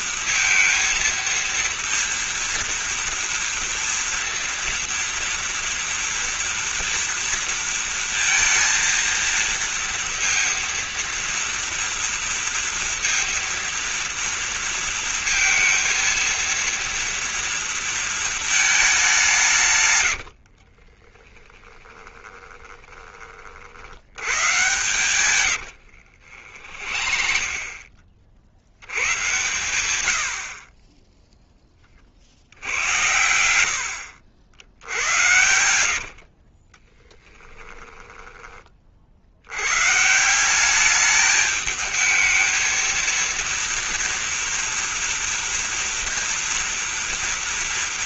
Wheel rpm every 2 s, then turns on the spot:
230, 230, 230, 230, 230, 240, 230, 230, 230, 220, 50, 20, 130, 60, 80, 40, 90, 70, 30, 30, 200, 230, 230, 230.
20-28 34-38